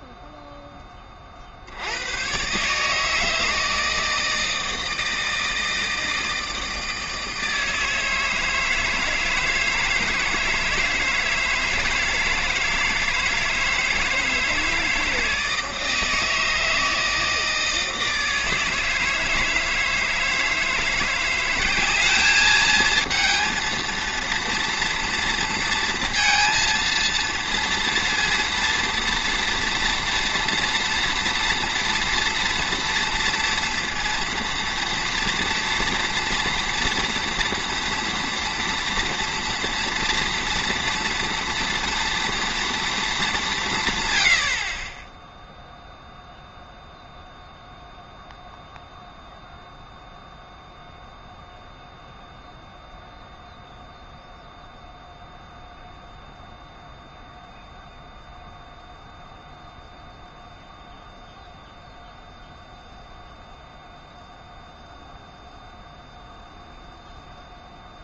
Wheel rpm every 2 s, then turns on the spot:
10, 140, 160, 160, 160, 160, 150, 160, 160, 160, 160, 220, 230, 230, 230, 240, 240, 240, 230, 230, 230, 230, 60, 0, 0, 0, 0, 0, 0, 0, 0, 0, 0, 0.
none